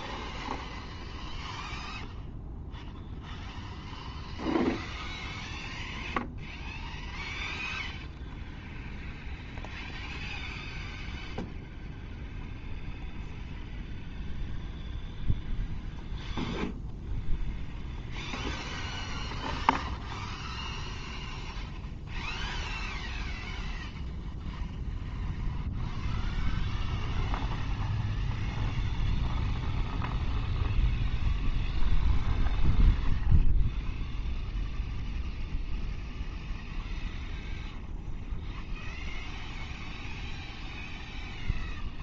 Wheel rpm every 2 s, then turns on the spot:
0, 0, 0, 0, 0, 0, 0, 0, 0, 0, 0, 0, 0, 0, 0, 0, 0, 0, 0, 0, 0.
none